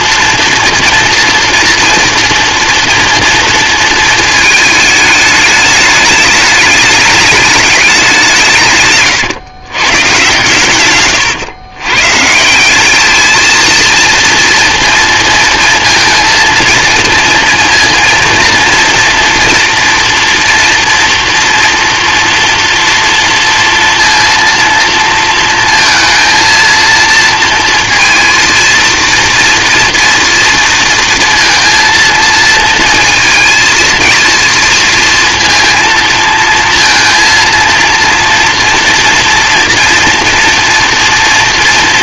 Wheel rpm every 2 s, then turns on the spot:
230, 230, 210, 210, 140, 130, 190, 230, 230, 230, 230, 230, 230, 230, 230, 230, 230, 230, 230, 230, 230.
8-10